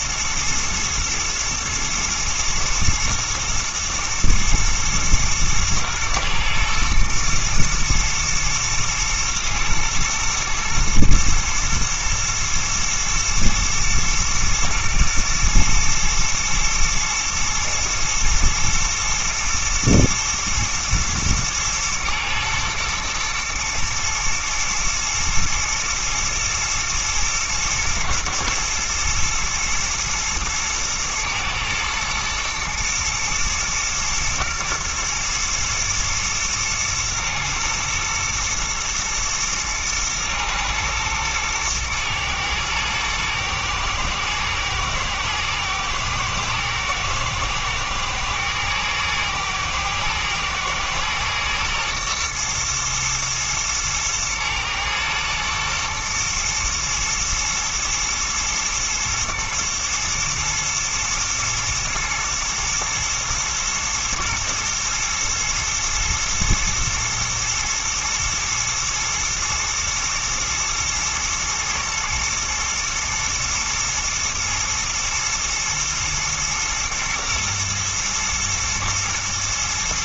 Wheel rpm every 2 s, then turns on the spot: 120, 110, 120, 110, 120, 120, 110, 120, 110, 120, 110, 110, 110, 120, 120, 110, 120, 120, 120, 120, 110, 110, 110, 110, 110, 120, 110, 110, 120, 110, 120, 120, 110, 110, 110, 110, 120, 110, 120, 120.
none